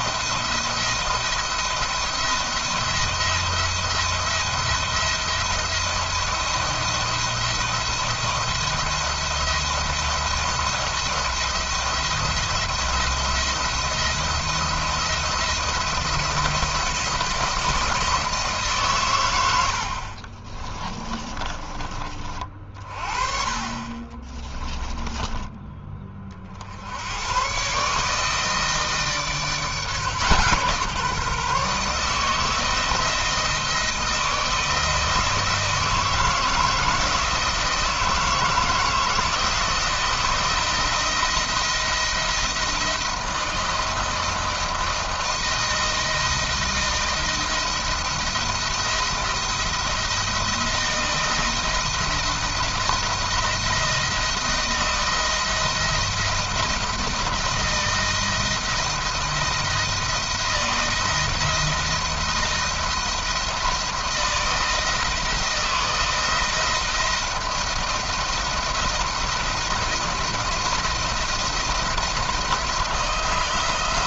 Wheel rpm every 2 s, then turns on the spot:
170, 170, 170, 170, 170, 170, 170, 170, 170, 150, 30, 40, 30, 50, 160, 150, 160, 160, 160, 170, 170, 170, 160, 160, 170, 170, 170, 160, 170, 160, 160, 170, 160, 170, 170, 170, 170.
20-22 24-26